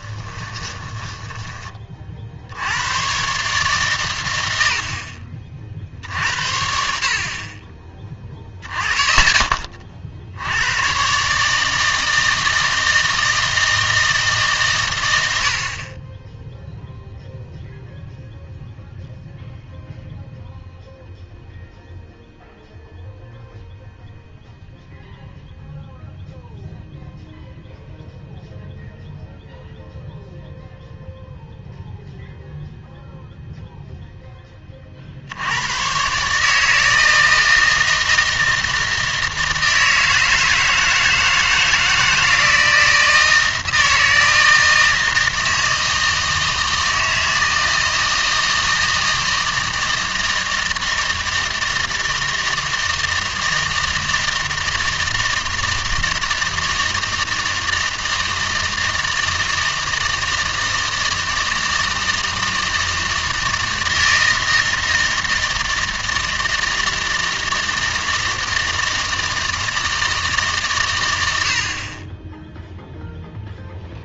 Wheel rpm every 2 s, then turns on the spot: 10, 80, 80, 60, 20, 100, 160, 140, 0, 0, 0, 0, 0, 0, 0, 0, 0, 30, 150, 160, 160, 160, 160, 160, 160, 160, 160, 160, 160, 160, 160, 160, 160, 160, 160, 140, 0.
0-2